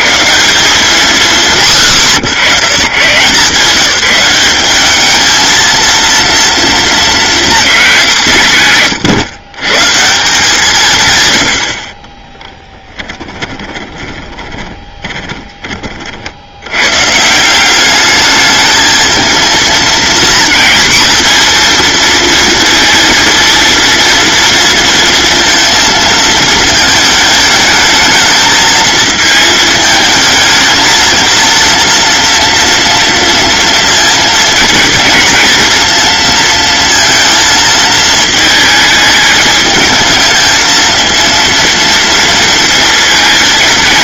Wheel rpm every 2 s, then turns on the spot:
180, 140, 210, 230, 140, 130, 20, 20, 120, 220, 230, 230, 230, 220, 220, 220, 230, 230, 230, 220, 230, 230.
12-16